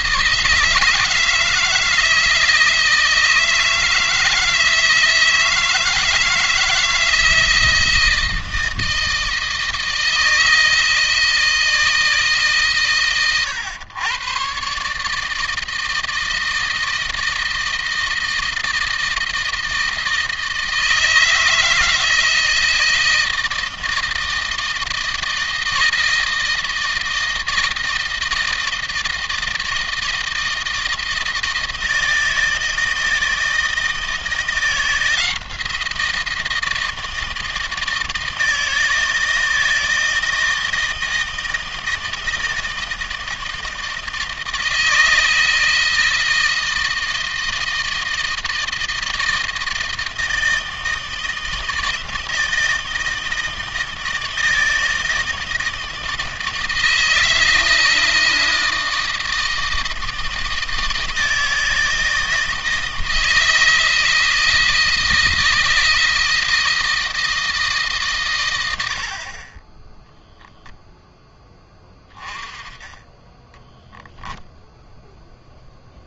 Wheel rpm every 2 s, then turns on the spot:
160, 160, 160, 160, 160, 160, 130, 150, 160, 160, 160, 160, 160, 160, 160, 160, 160, 170, 160, 160, 160, 160, 160, 160, 160, 160, 160, 160, 160, 160, 160, 160, 170, 160, 80, 0, 10, 0.
68-70